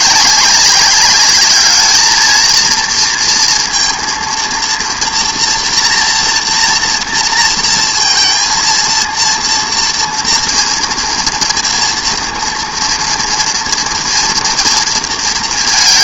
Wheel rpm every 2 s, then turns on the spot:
200, 230, 230, 230, 230, 230, 230, 230.
none